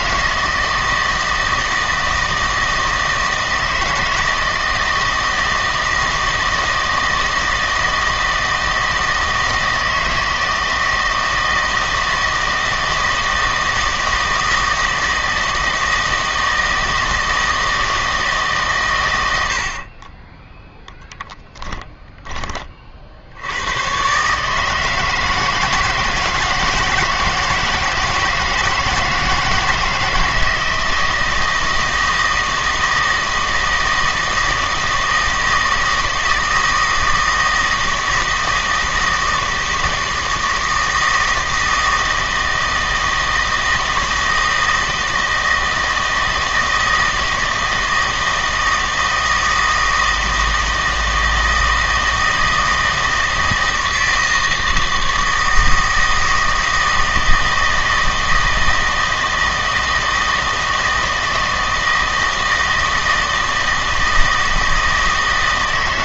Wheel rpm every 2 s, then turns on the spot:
160, 160, 160, 160, 160, 160, 160, 160, 160, 140, 10, 30, 150, 160, 160, 160, 160, 160, 160, 160, 160, 160, 160, 160, 160, 160, 160, 160, 160, 160, 160, 160, 160.
none